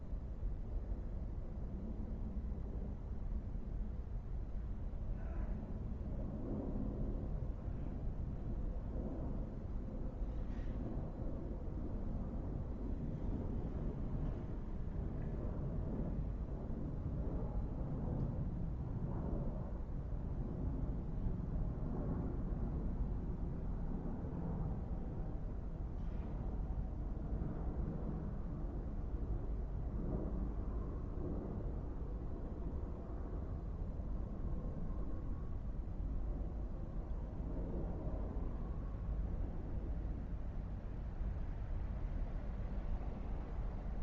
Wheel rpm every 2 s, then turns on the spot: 0, 0, 0, 0, 0, 0, 0, 0, 0, 0, 0, 0, 0, 0, 0, 0, 0, 0, 0, 0, 0, 0.
none